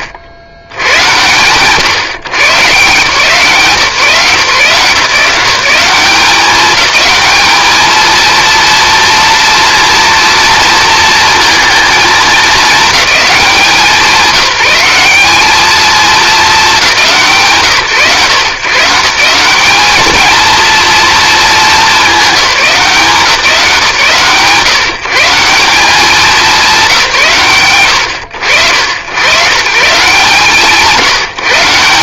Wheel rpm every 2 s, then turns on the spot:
90, 140, 170, 210, 230, 230, 210, 190, 190, 170, 230, 180, 140, 170, 90, 140.
none